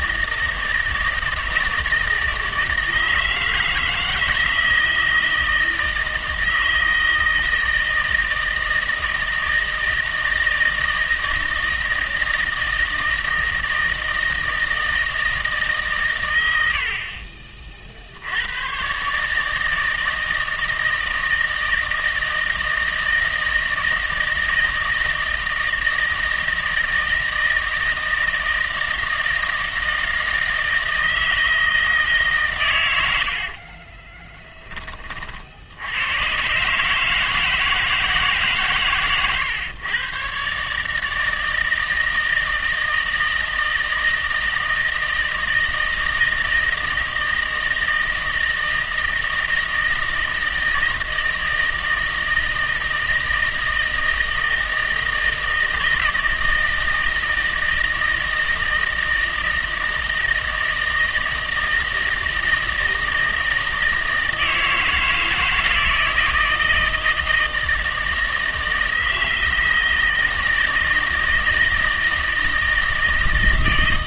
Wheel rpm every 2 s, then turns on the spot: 160, 160, 160, 160, 160, 160, 160, 160, 70, 120, 160, 160, 160, 160, 160, 160, 100, 20, 140, 140, 150, 160, 170, 160, 160, 160, 160, 160, 160, 160, 160, 160, 160, 160, 160, 160, 160.
none